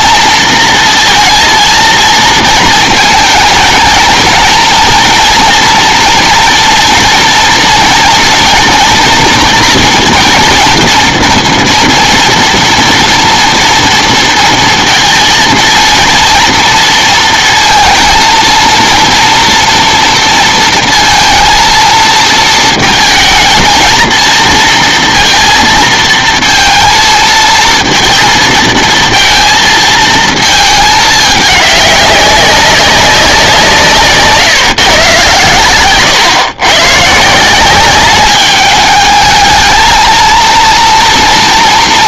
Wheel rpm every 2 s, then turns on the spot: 230, 220, 230, 230, 230, 230, 230, 230, 230, 230, 230, 220, 230, 220, 220, 220, 200, 150, 150, 210, 230.
none